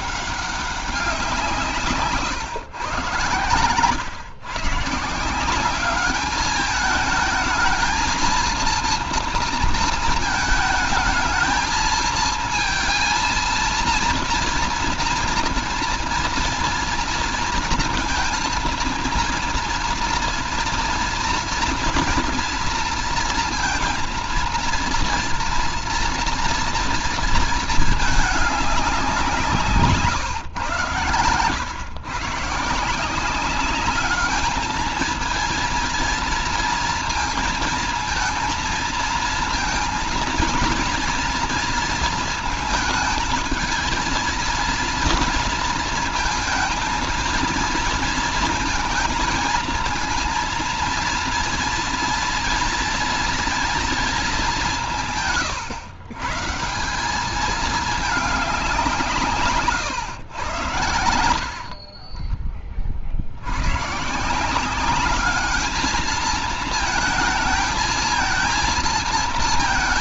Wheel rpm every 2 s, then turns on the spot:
200, 130, 130, 210, 230, 220, 230, 230, 230, 230, 230, 240, 230, 230, 210, 120, 140, 220, 230, 230, 230, 220, 230, 230, 230, 230, 230, 200, 140, 190, 110, 30, 160, 220, 230.
62-64